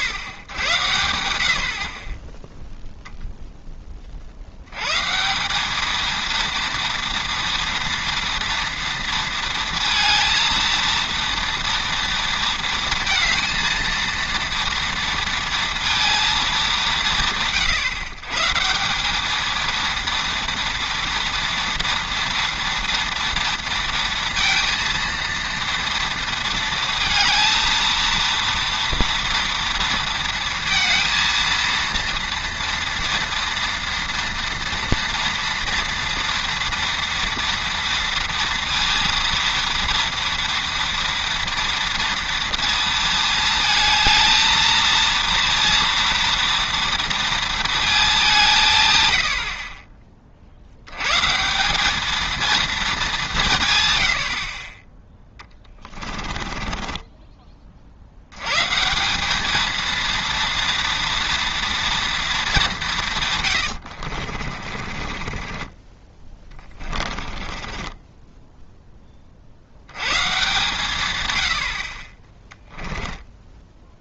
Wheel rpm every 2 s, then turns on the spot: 80, 0, 100, 230, 230, 230, 230, 230, 200, 160, 230, 230, 230, 230, 240, 230, 230, 230, 230, 230, 230, 230, 230, 230, 150, 80, 220, 30, 20, 150, 230, 190, 30, 20, 10, 130, 10.
56-58 64-68 72-74